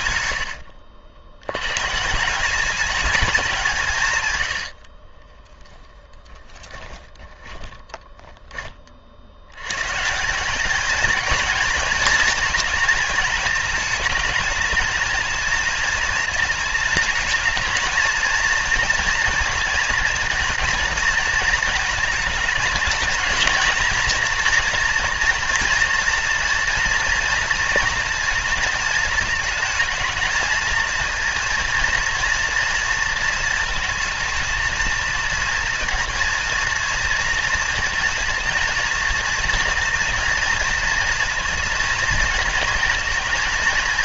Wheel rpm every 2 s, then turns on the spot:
80, 200, 90, 20, 20, 210, 230, 220, 220, 230, 220, 220, 240, 230, 230, 230, 230, 220, 230, 240, 230, 230.
0-2 4-8